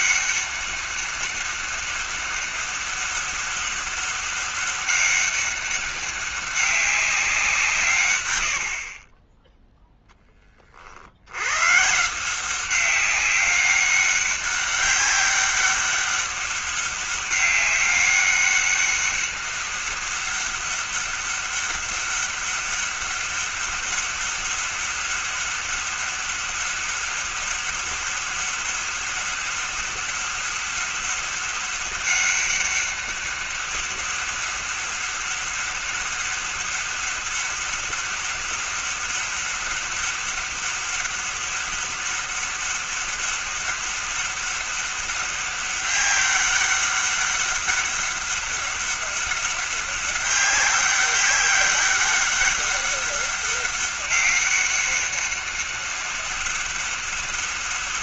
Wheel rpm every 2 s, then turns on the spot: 200, 200, 200, 200, 70, 40, 190, 200, 200, 200, 200, 200, 200, 200, 200, 200, 200, 200, 200, 200, 200, 200, 200, 200, 200, 200, 200, 200, 200.
none